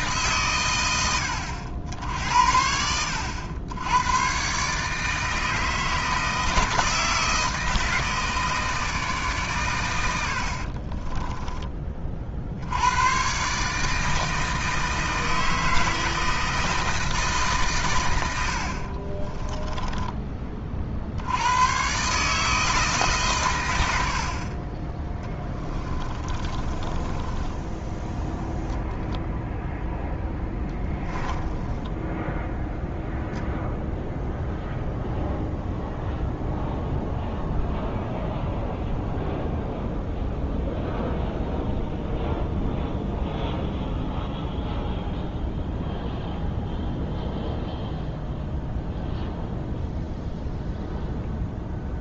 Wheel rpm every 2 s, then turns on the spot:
110, 80, 150, 160, 150, 40, 110, 160, 160, 40, 50, 150, 30, 20, 0, 10, 0, 0, 0, 0, 0, 0, 0, 0, 0, 0.
10-12 18-20 26-28 30-32